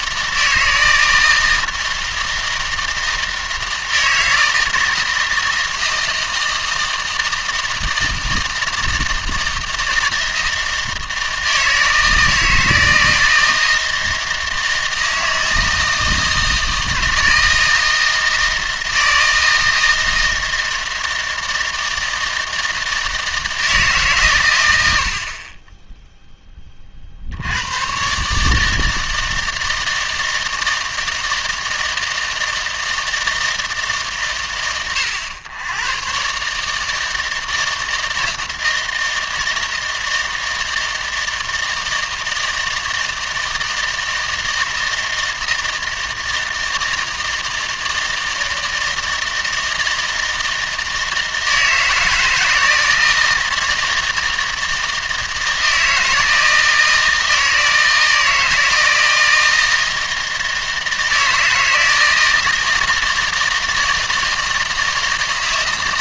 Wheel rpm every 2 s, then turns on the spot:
160, 160, 160, 160, 160, 160, 160, 160, 160, 160, 160, 160, 110, 20, 150, 160, 160, 90, 150, 160, 160, 160, 160, 160, 160, 160, 160, 160, 160, 160, 160, 160, 160.
none